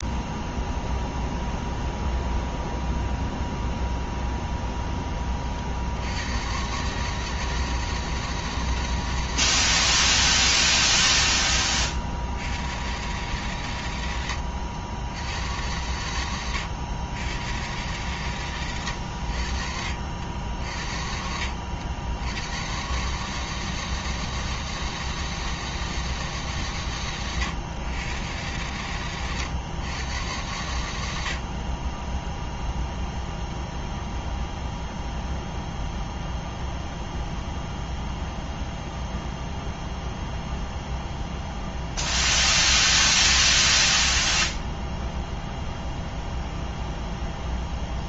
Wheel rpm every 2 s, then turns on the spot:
0, 0, 0, 120, 160, 110, 90, 90, 90, 110, 60, 100, 160, 140, 110, 90, 0, 0, 0, 0, 0, 0, 0, 0.
none